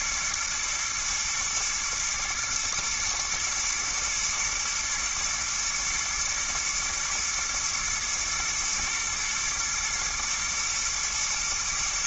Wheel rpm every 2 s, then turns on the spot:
120, 120, 110, 110, 120, 120.
none